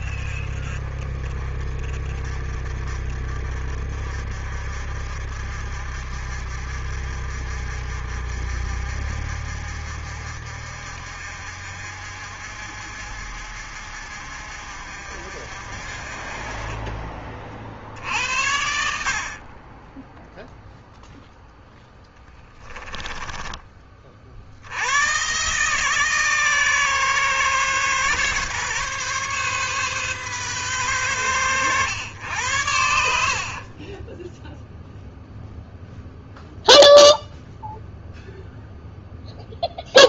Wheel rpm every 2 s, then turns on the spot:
40, 50, 50, 50, 50, 50, 50, 50, 30, 70, 0, 10, 80, 140, 130, 120, 90, 0, 0, 0.
22-24